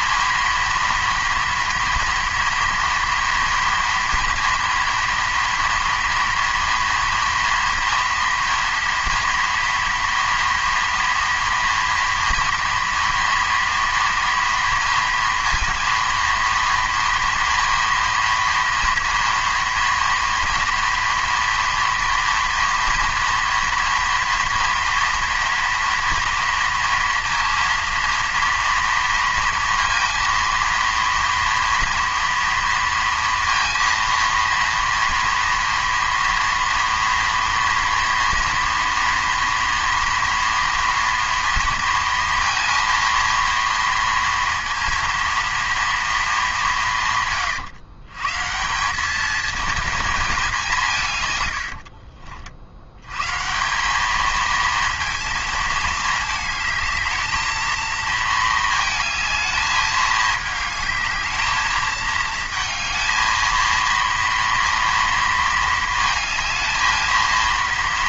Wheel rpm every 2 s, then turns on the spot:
240, 230, 230, 230, 230, 230, 230, 230, 230, 230, 230, 230, 230, 230, 230, 230, 230, 230, 230, 230, 230, 230, 230, 190, 170, 190, 70, 220, 220, 220, 220, 220, 230, 220.
none